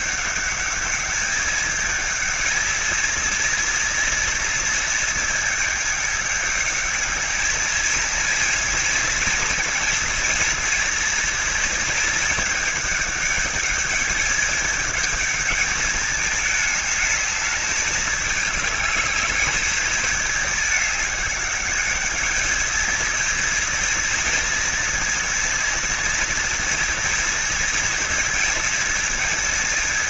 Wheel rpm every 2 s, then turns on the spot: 210, 220, 230, 210, 230, 230, 210, 210, 210, 210, 210, 220, 230, 230, 230.
none